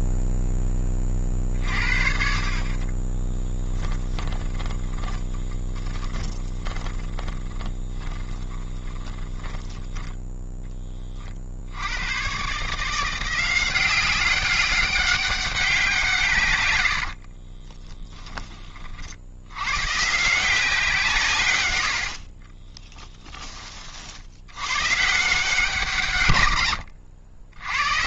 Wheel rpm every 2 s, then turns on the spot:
20, 40, 20, 20, 10, 10, 150, 200, 110, 30, 170, 30, 110, 80.
2-10 22-24 26-28